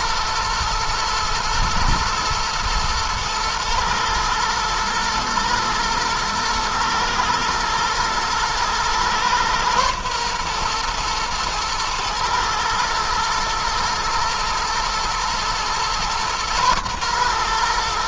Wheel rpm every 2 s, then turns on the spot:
120, 120, 120, 110, 120, 120, 110, 120, 120.
none